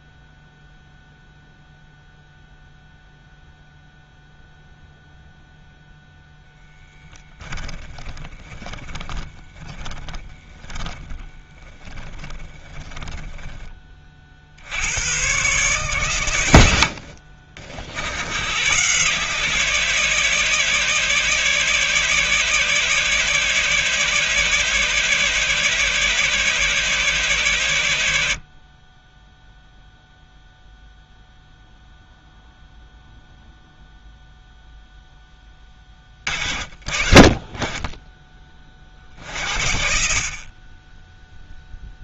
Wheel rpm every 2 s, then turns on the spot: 0, 0, 0, 10, 20, 20, 20, 80, 90, 120, 150, 150, 150, 150, 40, 0, 0, 0, 40, 30, 30.
8-14